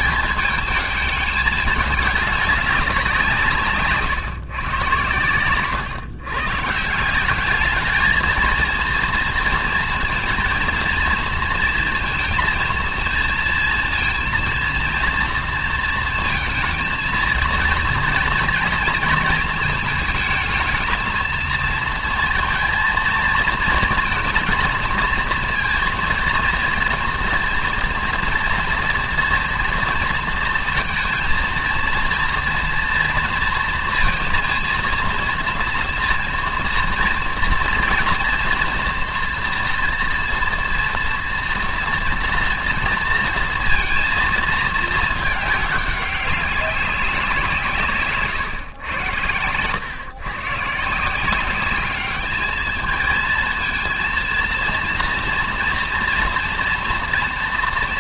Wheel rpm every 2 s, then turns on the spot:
210, 190, 130, 150, 230, 230, 230, 230, 220, 230, 220, 230, 220, 230, 230, 230, 240, 230, 230, 230, 230, 230, 220, 190, 120, 140, 220, 230, 230.
none